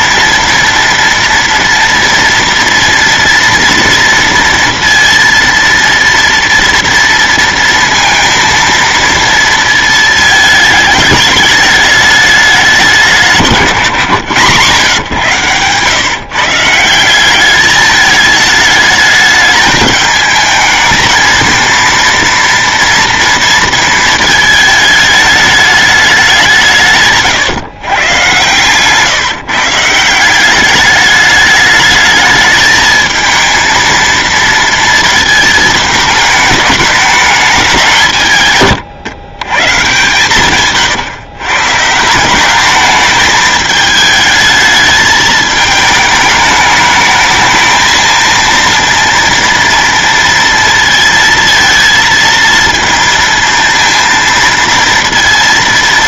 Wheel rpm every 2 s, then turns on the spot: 230, 230, 230, 230, 230, 220, 200, 120, 160, 210, 220, 230, 220, 160, 120, 200, 220, 230, 210, 130, 140, 200, 220, 210, 230, 230, 230, 230.
none